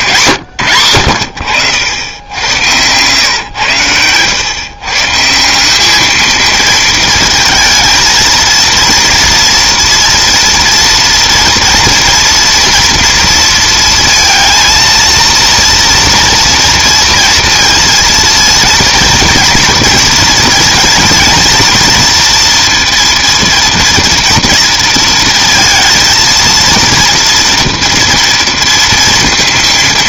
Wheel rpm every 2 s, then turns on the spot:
100, 110, 120, 220, 230, 230, 230, 230, 230, 230, 230, 230, 230, 230, 230.
none